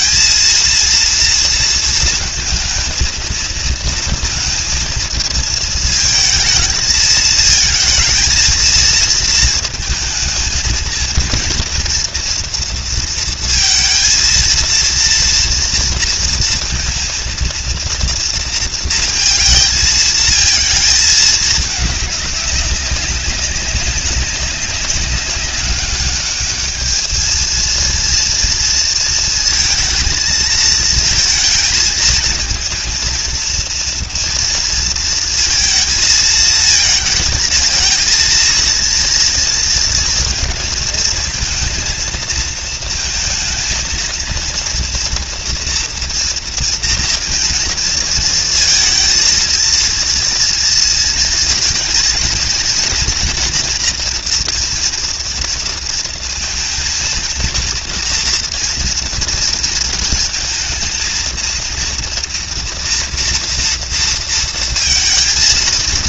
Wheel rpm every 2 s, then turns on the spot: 230, 230, 230, 220, 230, 220, 230, 230, 230, 230, 220, 200, 200, 220, 230, 230, 230, 230, 220, 230, 230, 230, 230, 230, 220, 230, 230, 230, 230, 230, 230, 240, 230.
none